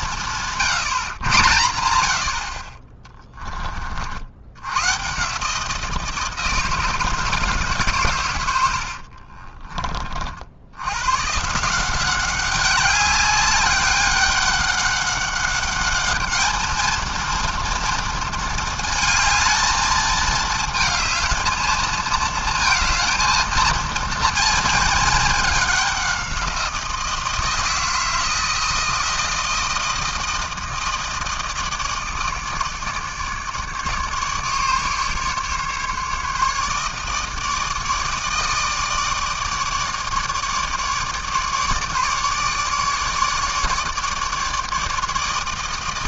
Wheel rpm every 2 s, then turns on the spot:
150, 50, 110, 160, 90, 80, 190, 200, 220, 220, 220, 230, 230, 170, 160, 160, 150, 150, 150, 160, 150, 150, 150.
8-10